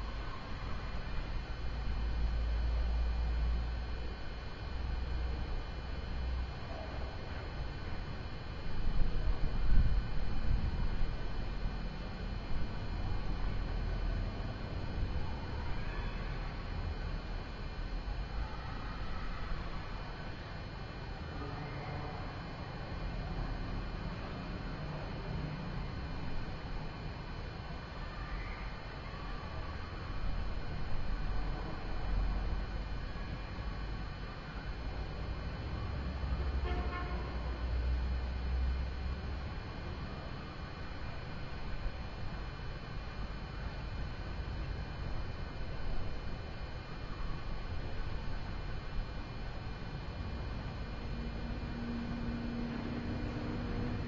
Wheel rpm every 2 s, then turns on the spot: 0, 0, 0, 0, 0, 0, 0, 0, 0, 0, 0, 0, 0, 0, 0, 0, 0, 0, 0, 0, 0, 0, 0, 0, 0, 0, 0.
none